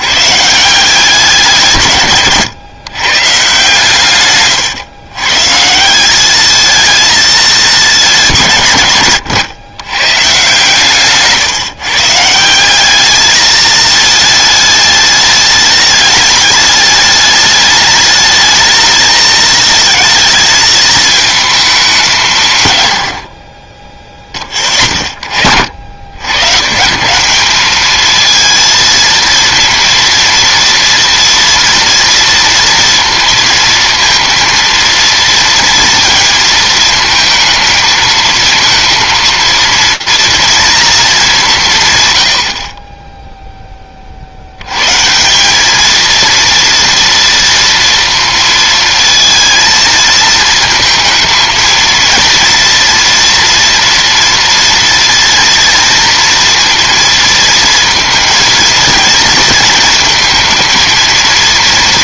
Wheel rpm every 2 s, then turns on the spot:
170, 130, 120, 220, 150, 140, 190, 210, 210, 220, 220, 120, 30, 150, 230, 230, 230, 230, 230, 230, 220, 40, 110, 240, 230, 220, 230, 230, 230, 230, 230.
none